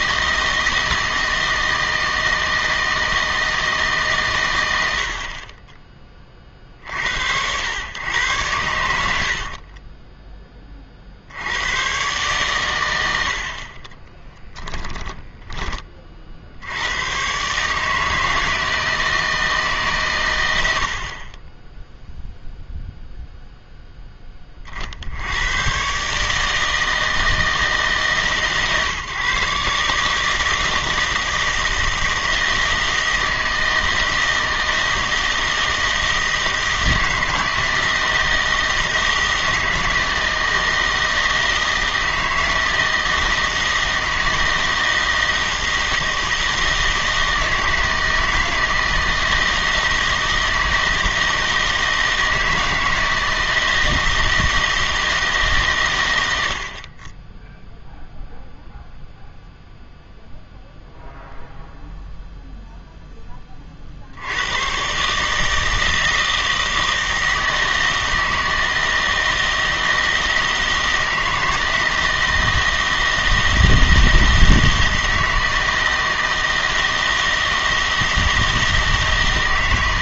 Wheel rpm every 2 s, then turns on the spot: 160, 160, 100, 60, 100, 30, 120, 10, 70, 160, 90, 0, 40, 160, 140, 160, 160, 160, 160, 160, 160, 160, 160, 160, 160, 160, 160, 160, 60, 0, 0, 0, 110, 160, 160, 160, 160, 160, 160, 160.
8-10 14-16